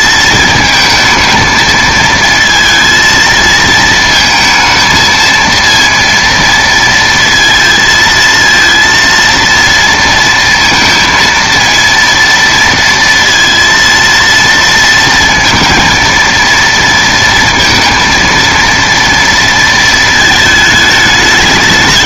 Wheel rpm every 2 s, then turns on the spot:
220, 220, 220, 230, 230, 230, 230, 230, 230, 230, 210.
none